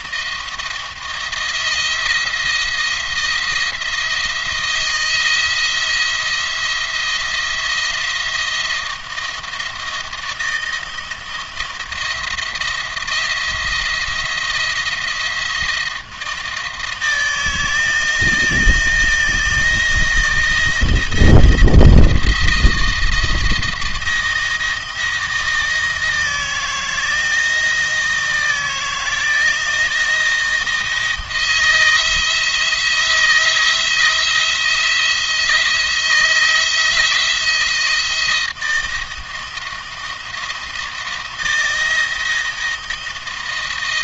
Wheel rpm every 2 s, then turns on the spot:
170, 170, 160, 170, 170, 170, 170, 170, 160, 160, 170, 170, 170, 160, 160, 170, 160, 170, 170, 160, 170, 160.
none